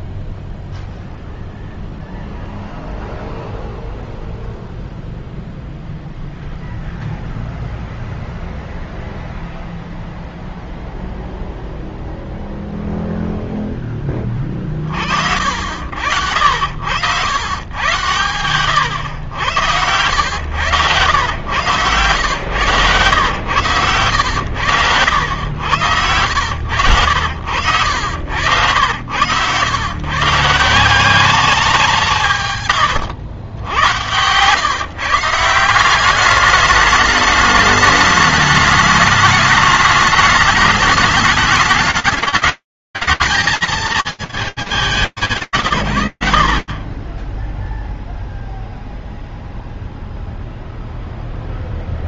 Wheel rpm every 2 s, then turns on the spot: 0, 0, 0, 0, 0, 0, 0, 10, 80, 100, 110, 110, 120, 100, 90, 130, 180, 100, 180, 210, 210, 220, 170, 0, 0, 0.
22-24